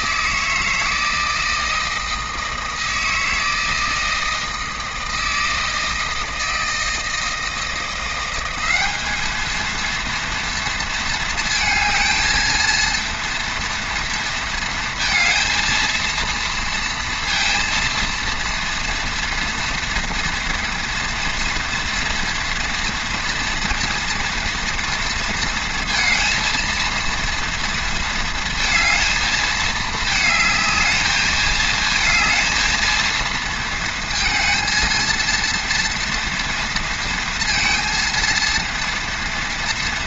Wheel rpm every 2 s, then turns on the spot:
160, 160, 160, 160, 200, 230, 230, 230, 230, 230, 230, 230, 230, 230, 220, 220, 230, 230, 230, 230.
none